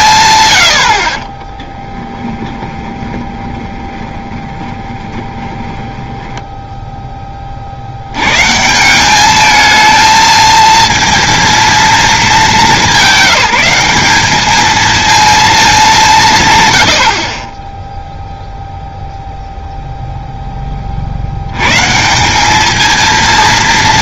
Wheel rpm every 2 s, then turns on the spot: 80, 20, 30, 10, 170, 230, 200, 220, 100, 0, 20, 220.
2-6